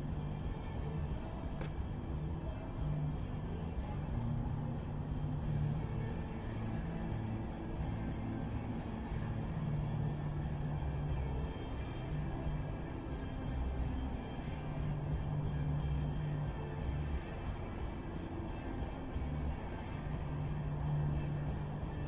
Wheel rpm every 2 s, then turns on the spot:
0, 0, 0, 0, 0, 0, 0, 0, 0, 0, 0.
none